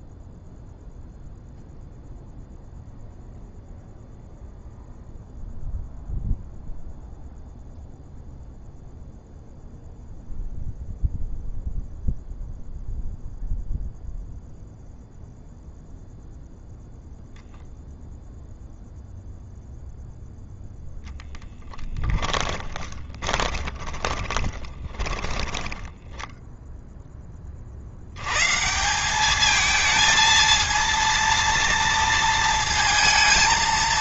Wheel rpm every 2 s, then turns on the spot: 0, 0, 0, 0, 0, 0, 0, 0, 0, 0, 0, 10, 10, 0, 130, 230, 230.
22-26